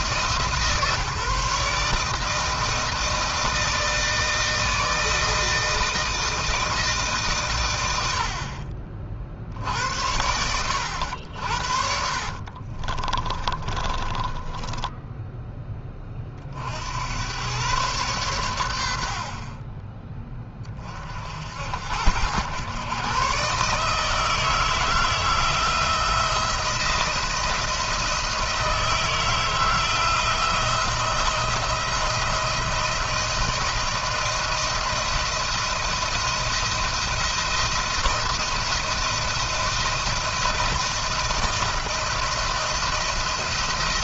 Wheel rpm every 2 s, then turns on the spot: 160, 160, 160, 160, 60, 90, 40, 20, 50, 100, 20, 110, 160, 160, 160, 170, 170, 170, 170, 170, 170, 170.
12-16